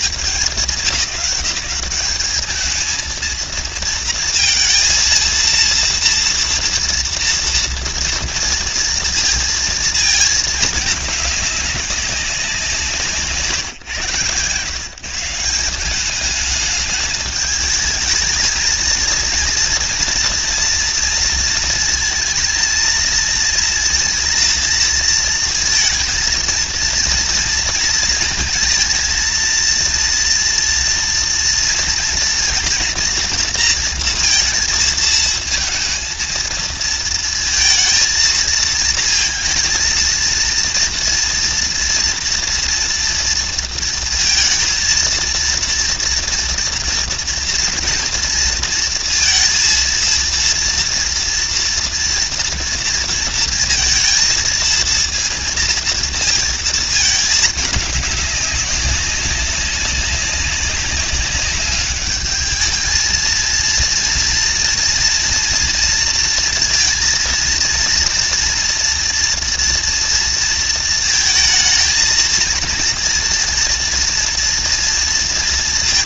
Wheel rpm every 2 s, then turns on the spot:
180, 230, 230, 230, 230, 210, 150, 170, 210, 230, 230, 230, 230, 230, 230, 230, 230, 220, 220, 220, 230, 230, 230, 230, 230, 230, 230, 230, 220, 200, 200, 220, 230, 230, 230, 220, 230, 230.
none